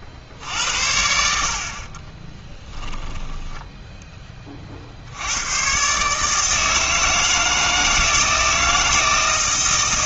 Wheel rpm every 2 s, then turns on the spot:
70, 10, 50, 160, 160.
none